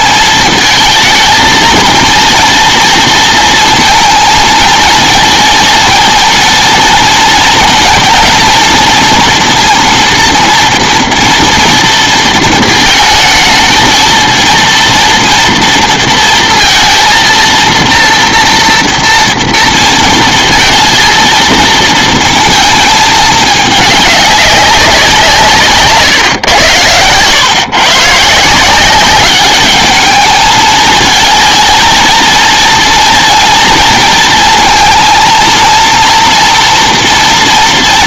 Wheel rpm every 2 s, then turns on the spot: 220, 230, 220, 230, 230, 230, 230, 230, 230, 240, 230, 220, 200, 110, 170, 220, 230, 230, 230.
none